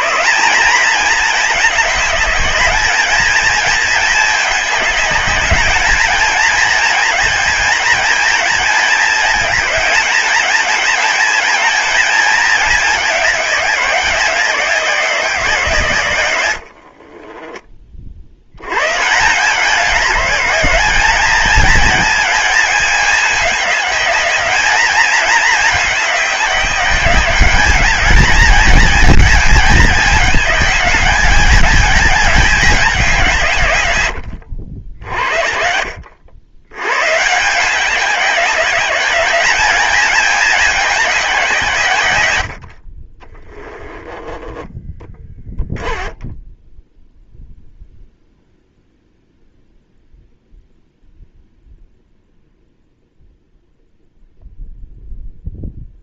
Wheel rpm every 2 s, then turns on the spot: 210, 210, 200, 220, 220, 210, 200, 180, 50, 140, 210, 210, 210, 190, 220, 200, 190, 50, 110, 190, 200, 50, 10, 0, 0, 0, 0, 0.
16-18 44-46